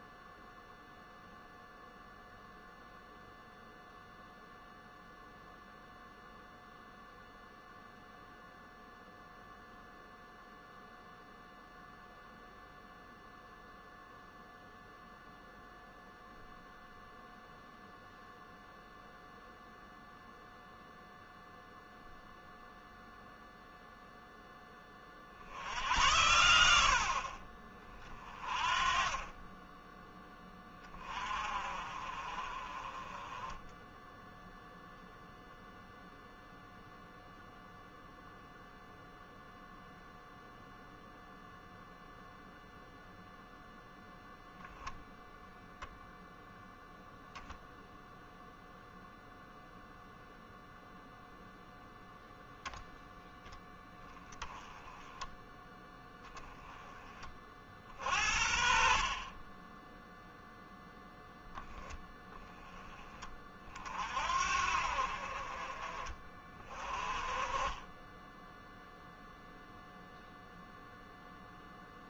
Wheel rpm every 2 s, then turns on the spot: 0, 0, 0, 0, 0, 0, 0, 0, 0, 0, 0, 0, 30, 60, 30, 20, 20, 0, 0, 0, 0, 0, 0, 0, 0, 0, 0, 10, 20, 50, 0, 20, 50, 30, 0, 0.
none